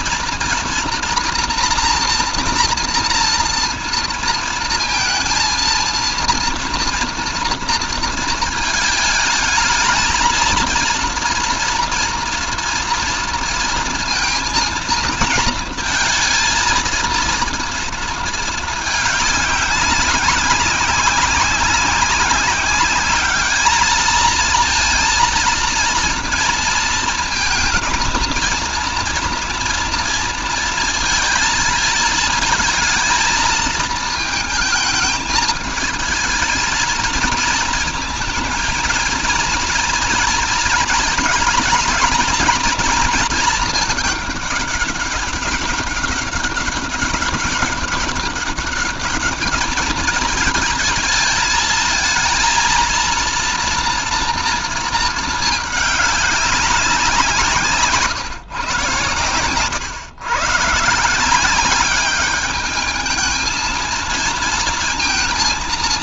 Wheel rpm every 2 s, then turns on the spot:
240, 230, 220, 230, 220, 240, 230, 230, 230, 210, 200, 210, 230, 230, 230, 220, 220, 220, 230, 230, 230, 230, 200, 200, 210, 220, 230, 220, 170, 120, 170, 220, 230.
none